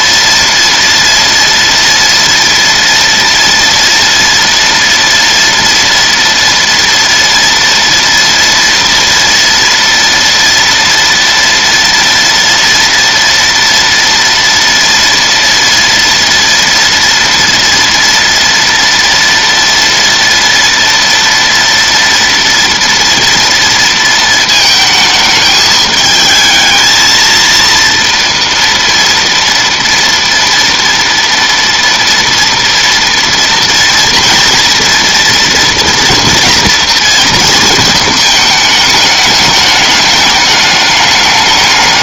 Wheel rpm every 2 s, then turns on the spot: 240, 230, 230, 230, 230, 230, 230, 230, 230, 230, 230, 230, 220, 220, 240, 230, 230, 230, 230, 210, 210.
none